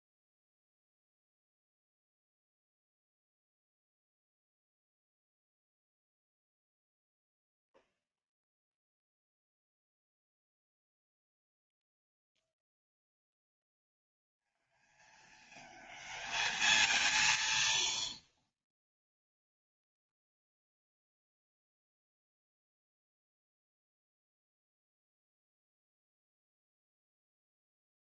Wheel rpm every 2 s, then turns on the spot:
0, 0, 0, 0, 0, 0, 0, 0, 0, 0, 0, 0, 0, 0.
none